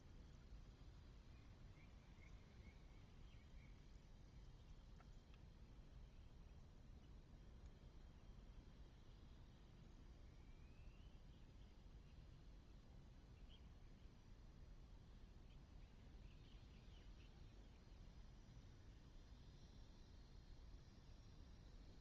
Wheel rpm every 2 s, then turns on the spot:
0, 0, 0, 0, 0, 0, 0, 0, 0, 0, 0.
none